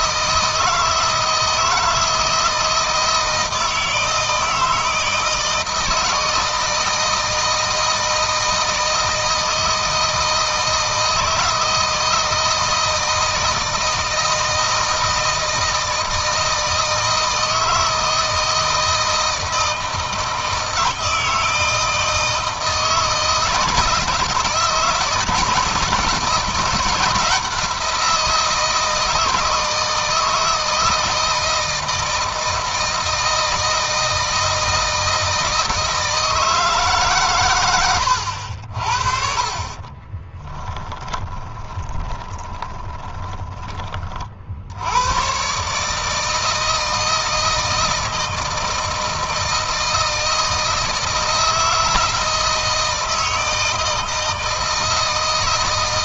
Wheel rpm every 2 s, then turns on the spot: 160, 160, 160, 160, 160, 160, 160, 160, 160, 160, 160, 160, 160, 170, 160, 160, 160, 160, 150, 50, 20, 20, 80, 160, 160, 160, 160, 160.
40-44